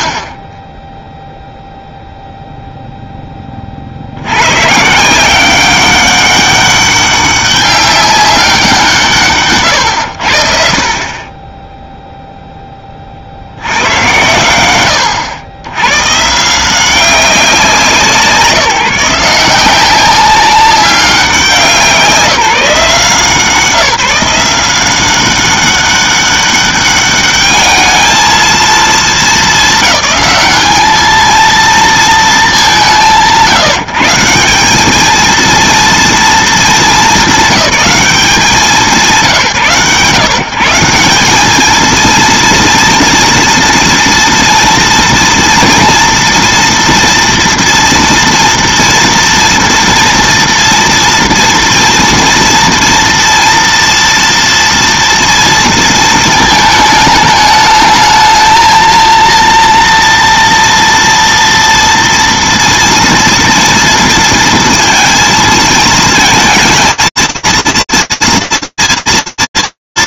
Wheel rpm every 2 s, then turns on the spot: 0, 10, 180, 200, 160, 30, 20, 110, 180, 180, 190, 170, 180, 200, 230, 220, 160, 210, 200, 160, 170, 230, 230, 230, 230, 230, 230, 230, 220, 220, 230, 230, 230, 230, 120.
none